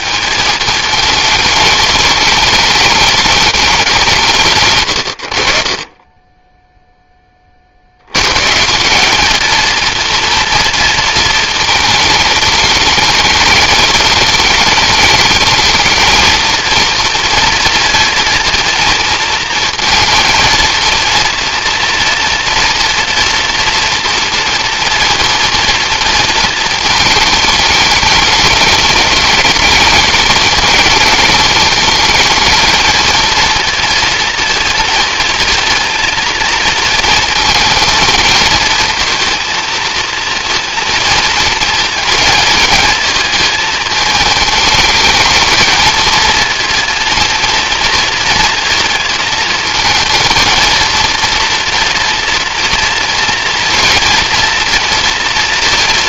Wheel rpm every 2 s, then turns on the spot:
220, 210, 110, 0, 190, 230, 200, 210, 230, 220, 230, 230, 230, 220, 210, 220, 220, 230, 230, 220, 230, 220, 220, 230, 230, 230, 230, 230.
none